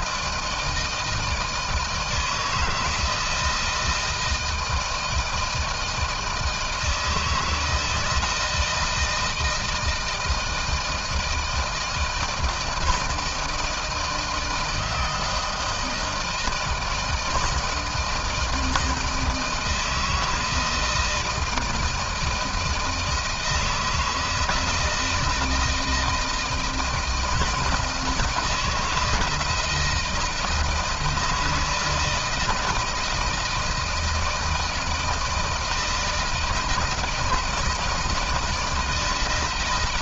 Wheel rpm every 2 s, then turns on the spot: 160, 160, 160, 160, 160, 160, 160, 160, 160, 160, 160, 160, 160, 160, 170, 160, 160, 160, 160, 160.
none